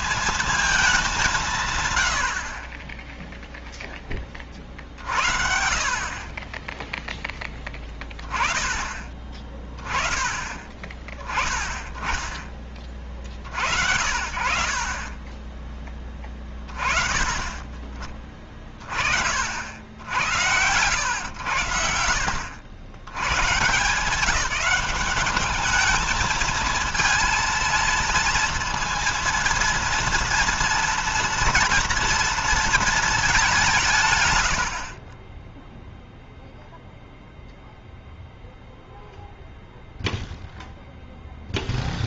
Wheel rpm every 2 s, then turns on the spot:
220, 40, 40, 30, 20, 20, 10, 50, 20, 40, 110, 80, 180, 220, 230, 230, 230, 80, 0, 0, 0.
none